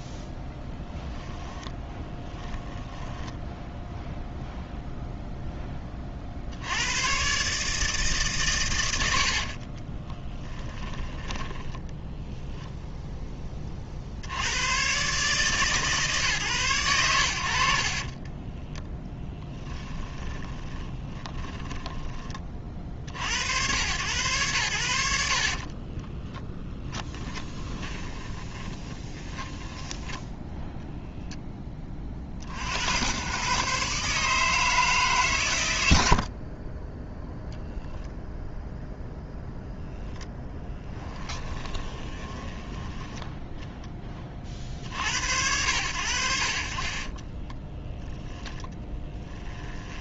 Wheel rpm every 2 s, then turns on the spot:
10, 10, 0, 100, 120, 10, 0, 130, 120, 0, 20, 40, 100, 10, 20, 0, 80, 160, 30, 0, 20, 10, 40, 60, 10.
0-2 10-12 20-22 26-30 40-44 48-50